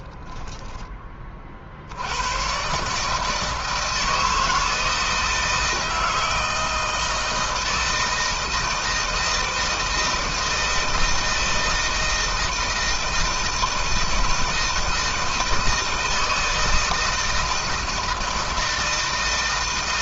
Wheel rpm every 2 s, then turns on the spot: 10, 150, 160, 160, 160, 160, 160, 160, 160, 160.
none